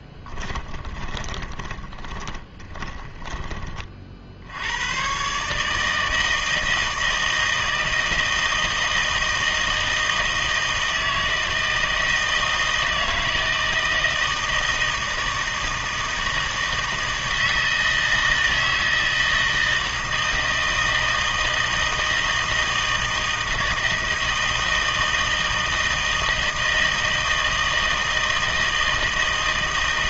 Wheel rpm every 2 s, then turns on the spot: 20, 20, 90, 160, 160, 160, 160, 160, 160, 160, 160, 160, 160, 160, 160.
0-4